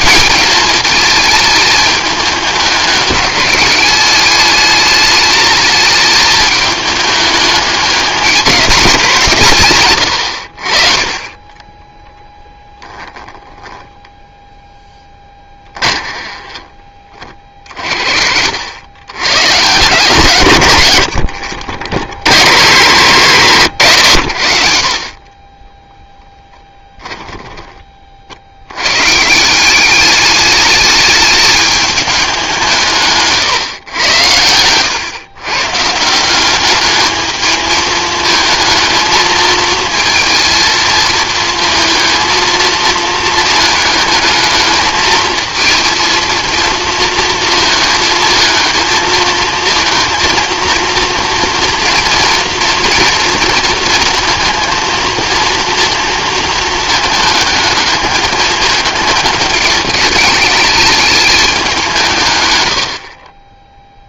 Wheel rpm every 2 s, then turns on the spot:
220, 200, 210, 210, 200, 50, 10, 0, 20, 60, 100, 80, 50, 10, 90, 210, 170, 110, 200, 220, 230, 220, 220, 230, 230, 230, 240, 230, 220, 220, 210, 110.
12-14 16-18 26-28